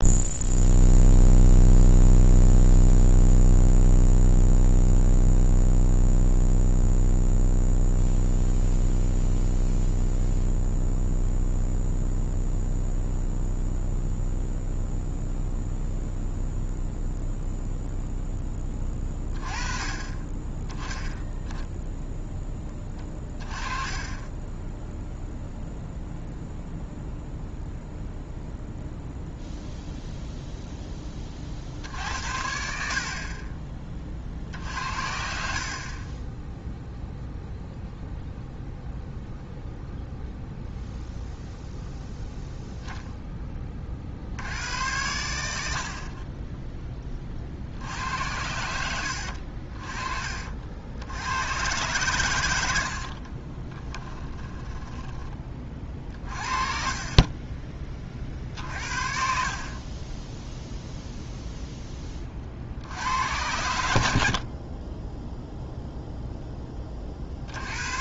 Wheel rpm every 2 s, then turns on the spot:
0, 0, 0, 0, 0, 0, 0, 0, 0, 10, 10, 10, 10, 0, 0, 0, 60, 60, 10, 0, 0, 0, 80, 20, 80, 50, 90, 30, 40, 50, 0, 50, 40, 10.
54-58